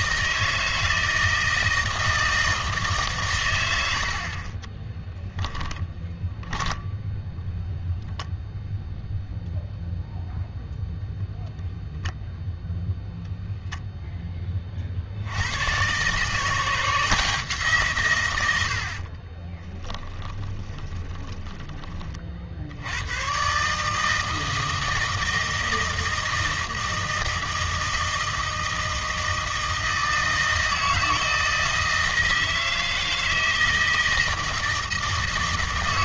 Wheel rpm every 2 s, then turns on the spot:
160, 160, 20, 0, 0, 0, 0, 30, 160, 90, 20, 70, 160, 160, 160, 160, 160, 170.
4-6 18-22